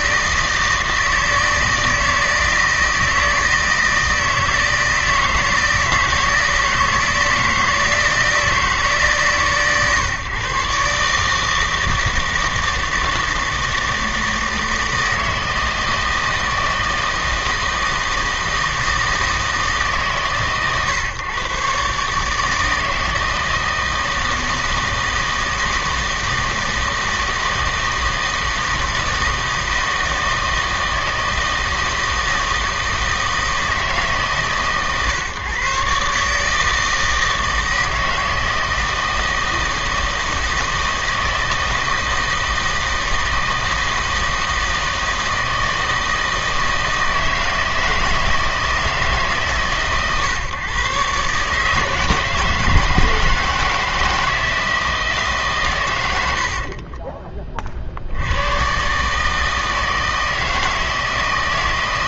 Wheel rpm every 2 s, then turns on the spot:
160, 160, 160, 160, 160, 140, 160, 160, 160, 160, 130, 150, 160, 160, 160, 160, 160, 150, 150, 160, 160, 160, 160, 160, 160, 130, 160, 160, 70, 100, 160.
56-58